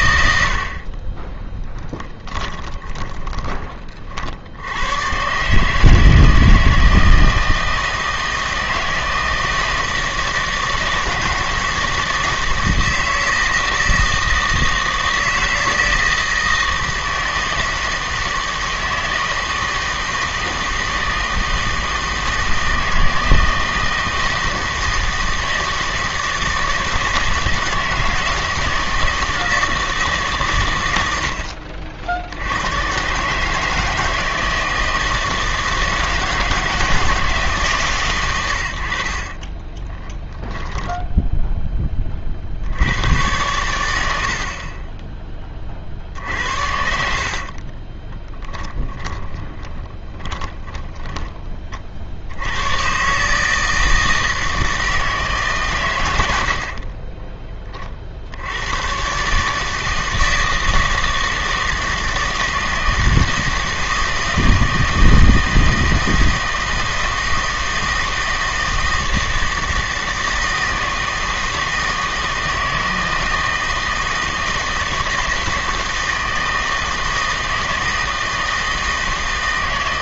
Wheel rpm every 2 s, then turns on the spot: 60, 30, 90, 160, 160, 160, 160, 160, 160, 160, 160, 160, 160, 160, 160, 120, 100, 160, 160, 90, 10, 60, 40, 70, 10, 10, 100, 160, 70, 100, 160, 160, 160, 160, 160, 160, 160, 160, 160, 160.
2-4 40-42 46-52 56-58